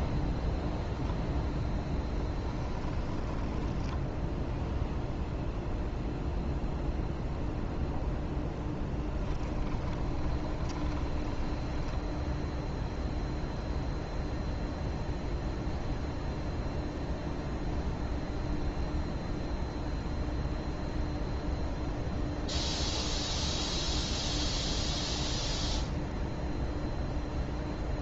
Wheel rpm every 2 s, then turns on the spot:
0, 20, 0, 0, 10, 20, 0, 0, 0, 0, 0, 0, 0, 0.
2-4 8-12